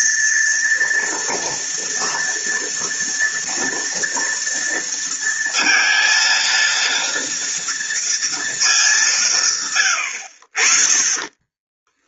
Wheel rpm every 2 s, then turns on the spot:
230, 230, 230, 230, 170, 30.
10-12